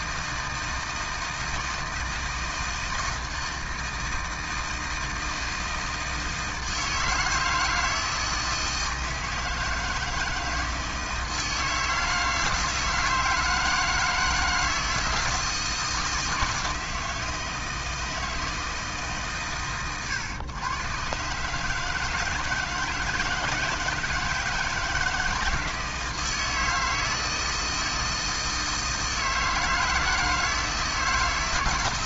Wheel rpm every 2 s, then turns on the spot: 160, 160, 160, 160, 160, 160, 160, 160, 160, 150, 120, 160, 160, 160, 160, 160.
none